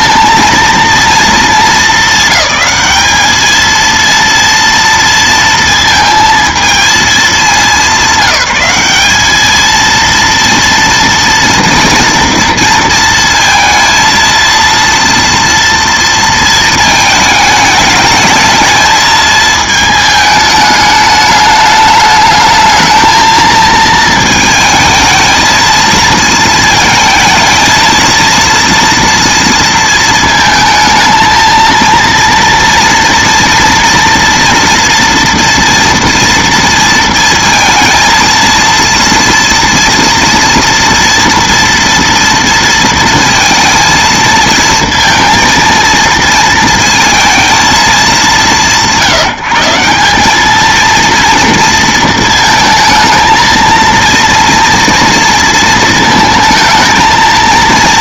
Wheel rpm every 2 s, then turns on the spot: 230, 200, 230, 220, 200, 230, 230, 230, 220, 220, 210, 220, 220, 220, 230, 220, 230, 230, 230, 230, 230, 230, 230, 230, 170, 220, 220, 230, 220.
none